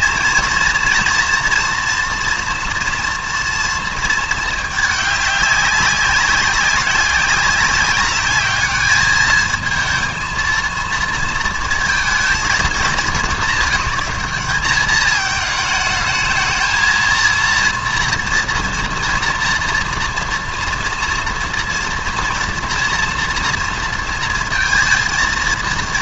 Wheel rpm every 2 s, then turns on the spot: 230, 240, 220, 190, 210, 220, 220, 200, 220, 230, 230, 230, 230.
none